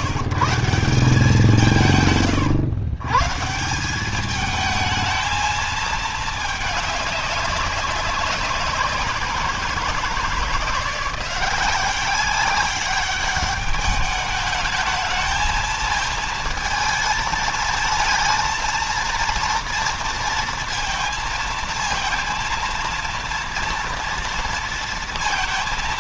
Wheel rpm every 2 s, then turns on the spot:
160, 130, 220, 210, 180, 170, 190, 210, 220, 230, 230, 230, 230.
none